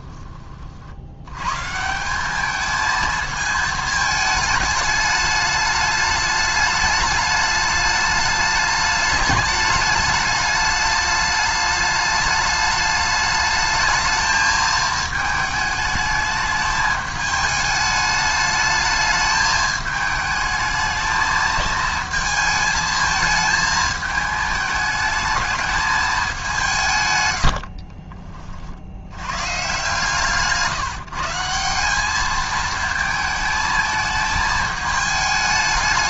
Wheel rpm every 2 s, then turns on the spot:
40, 210, 220, 210, 210, 210, 210, 220, 210, 210, 220, 220, 220, 170, 50, 160, 220, 220.
none